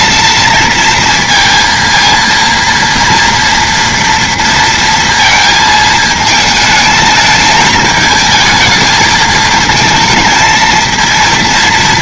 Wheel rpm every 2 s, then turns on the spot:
230, 230, 230, 220, 220, 230.
none